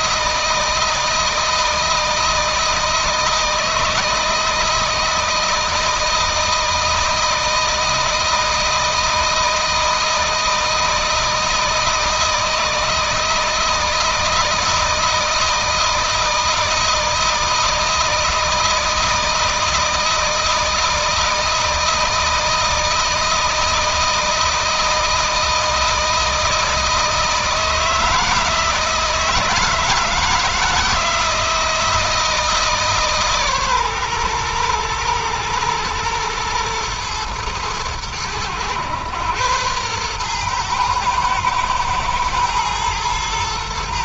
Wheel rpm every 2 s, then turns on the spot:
160, 160, 160, 160, 160, 160, 160, 160, 160, 160, 160, 160, 160, 160, 160, 160, 150, 120, 120, 110, 120, 120.
none